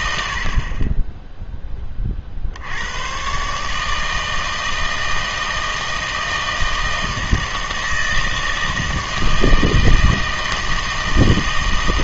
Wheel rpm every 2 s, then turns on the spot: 40, 80, 160, 160, 160, 160.
none